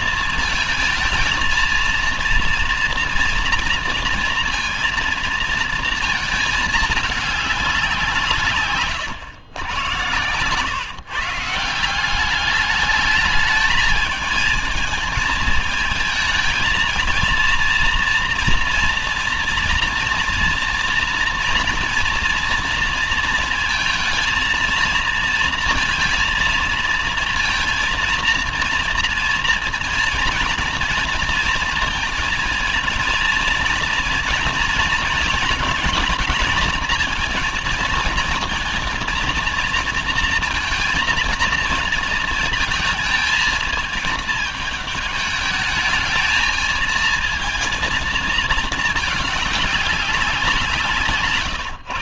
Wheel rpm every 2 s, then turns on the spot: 220, 240, 230, 210, 120, 150, 210, 220, 230, 230, 230, 230, 230, 230, 230, 230, 230, 230, 220, 230, 230, 220, 210, 220, 210, 150.
none